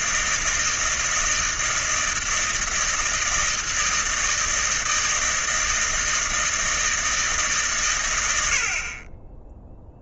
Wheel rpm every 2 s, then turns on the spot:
160, 160, 160, 160, 40.
none